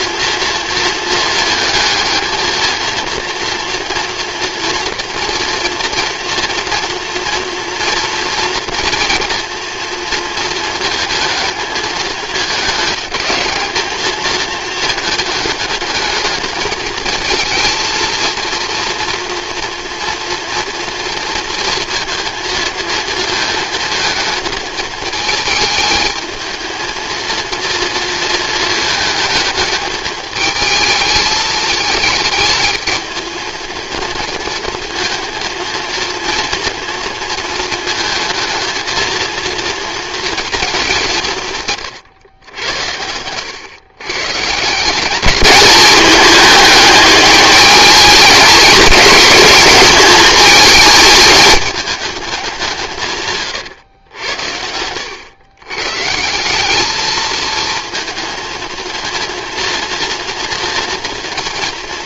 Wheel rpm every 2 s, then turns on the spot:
230, 230, 230, 230, 230, 220, 220, 230, 220, 230, 230, 230, 220, 220, 230, 220, 220, 220, 230, 230, 230, 100, 160, 210, 220, 220, 190, 80, 190, 230, 230.
none